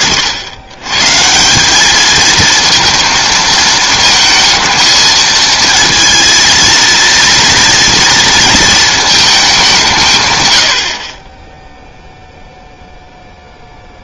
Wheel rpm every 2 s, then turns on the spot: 50, 230, 220, 230, 230, 110, 0.
none